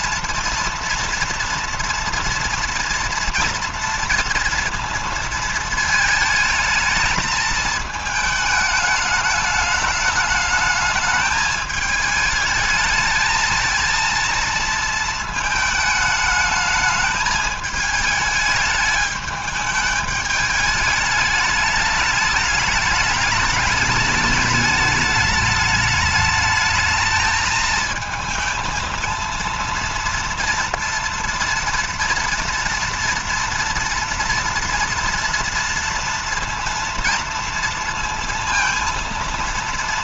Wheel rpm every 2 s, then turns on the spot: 230, 230, 230, 220, 210, 210, 220, 220, 210, 210, 210, 210, 210, 220, 220, 230, 230, 230, 230, 230.
none